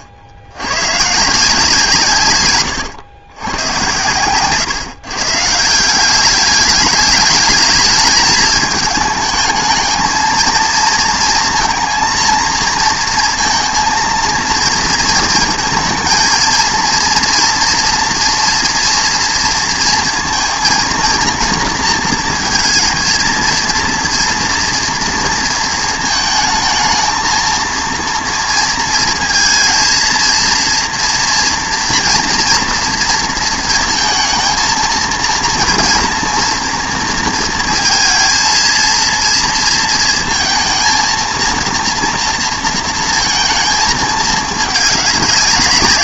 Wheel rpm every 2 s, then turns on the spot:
70, 120, 130, 200, 220, 230, 230, 230, 230, 240, 230, 230, 230, 220, 230, 230, 230, 220, 230, 230, 230, 230, 210.
none